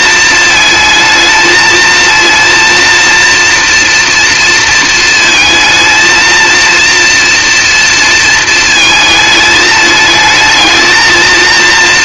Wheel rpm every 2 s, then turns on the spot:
220, 230, 220, 230, 220, 220.
none